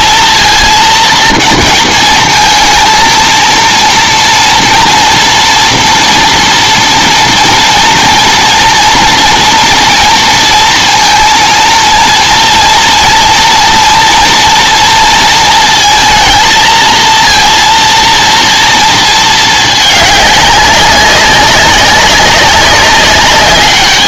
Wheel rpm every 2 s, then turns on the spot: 230, 220, 230, 230, 230, 230, 230, 230, 220, 230, 200, 200.
none